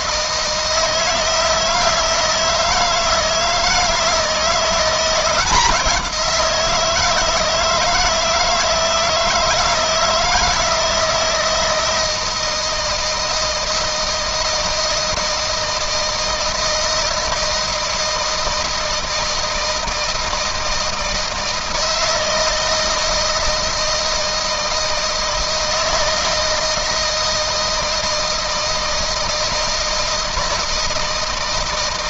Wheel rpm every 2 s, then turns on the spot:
160, 160, 170, 160, 160, 160, 160, 160, 160, 160, 160, 160, 160, 160, 160, 160.
none